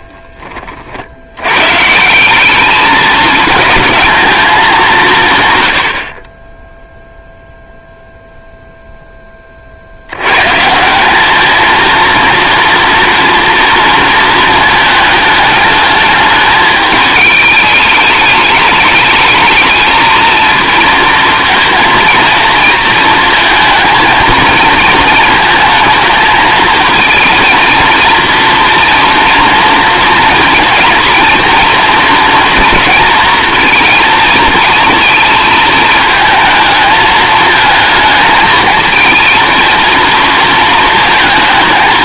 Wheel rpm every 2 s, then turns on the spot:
40, 210, 190, 0, 0, 170, 230, 220, 220, 210, 230, 230, 230, 230, 240, 230, 230, 230, 220, 220, 220.
none